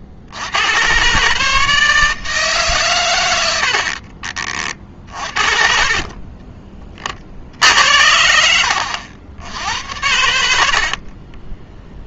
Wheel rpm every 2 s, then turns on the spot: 110, 130, 40, 30, 70, 50.
10-12